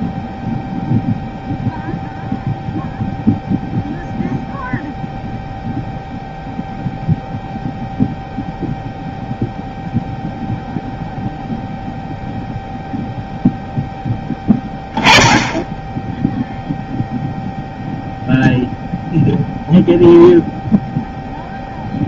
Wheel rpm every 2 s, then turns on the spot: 0, 0, 0, 0, 0, 0, 0, 10, 0, 0, 0.
none